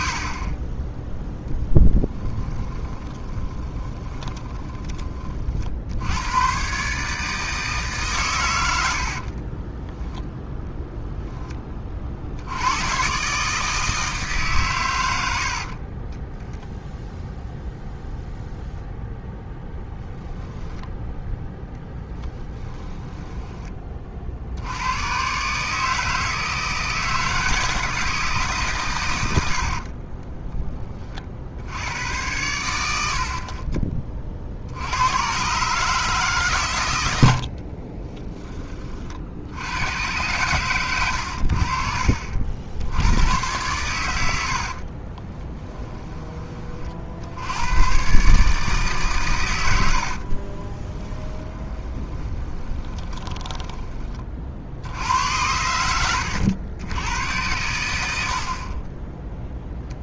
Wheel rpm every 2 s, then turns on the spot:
20, 10, 20, 120, 100, 0, 80, 130, 0, 0, 0, 10, 70, 160, 140, 10, 100, 60, 120, 20, 120, 60, 60, 30, 150, 30, 20, 60, 90, 50.
2-6 22-24 44-46 50-54